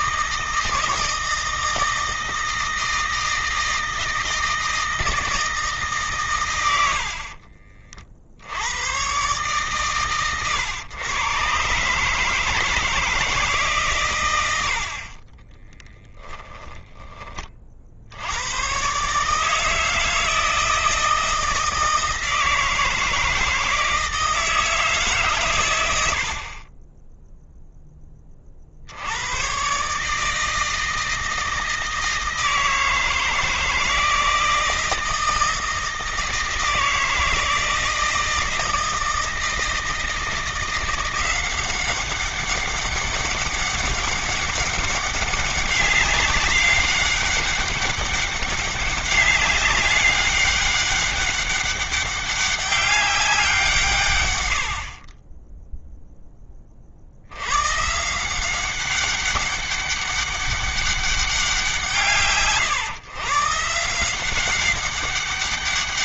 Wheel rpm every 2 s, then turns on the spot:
160, 160, 160, 80, 110, 120, 160, 70, 30, 130, 160, 160, 150, 20, 70, 160, 160, 160, 160, 160, 180, 200, 190, 200, 200, 200, 190, 60, 50, 190, 200, 140, 190.
16-18